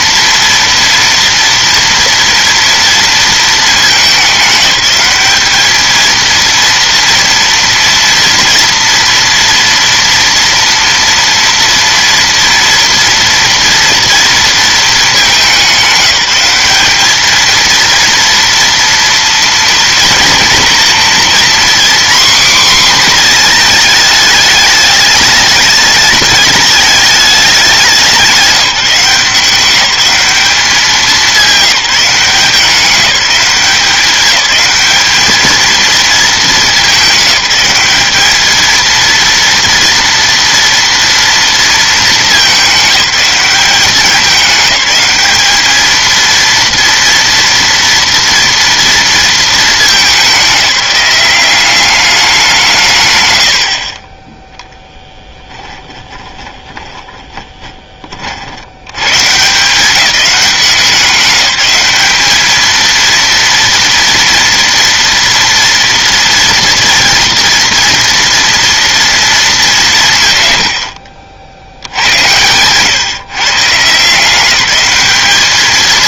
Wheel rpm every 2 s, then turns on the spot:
230, 230, 210, 230, 230, 230, 230, 230, 200, 230, 230, 250, 210, 210, 180, 200, 190, 210, 210, 220, 230, 200, 210, 230, 230, 200, 170, 20, 30, 80, 190, 220, 230, 230, 230, 100, 110, 190.
54-58